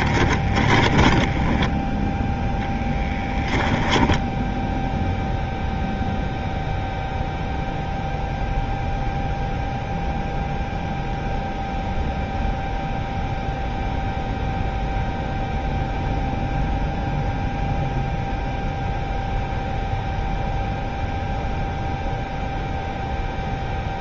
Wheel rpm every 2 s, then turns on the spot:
20, 10, 10, 0, 0, 0, 0, 0, 0, 0, 0, 0.
0-6